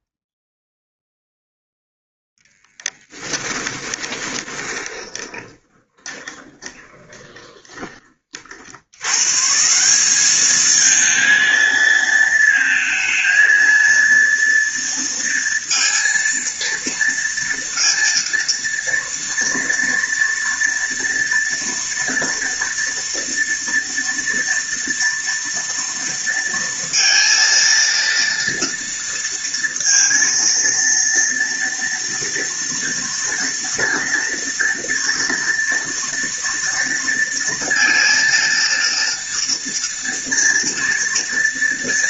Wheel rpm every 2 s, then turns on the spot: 10, 10, 20, 20, 70, 210, 230, 230, 230, 230, 230, 230, 230, 230, 230, 230, 230, 240, 230, 230, 230.
4-8